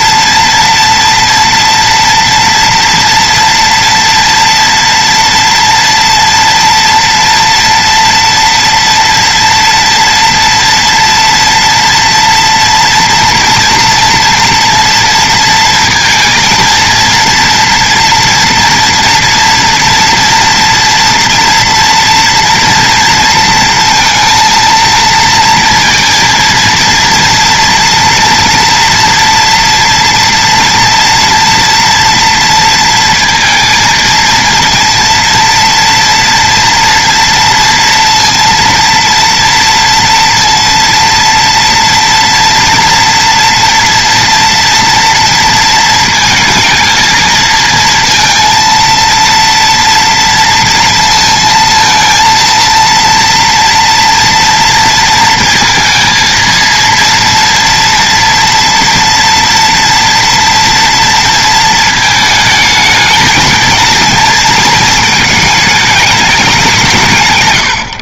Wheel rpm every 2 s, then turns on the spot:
240, 230, 240, 240, 230, 230, 230, 230, 230, 240, 240, 240, 230, 230, 230, 230, 230, 230, 230, 230, 230, 230, 230, 220, 230, 230, 230, 230, 230, 230, 230, 220, 220, 180.
none